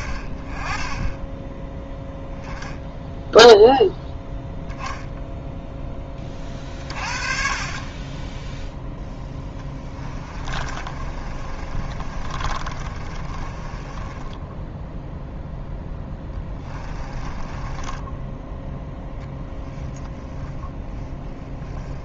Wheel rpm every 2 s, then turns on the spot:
20, 0, 0, 50, 10, 30, 30, 10, 10, 10, 10.
10-18 20-22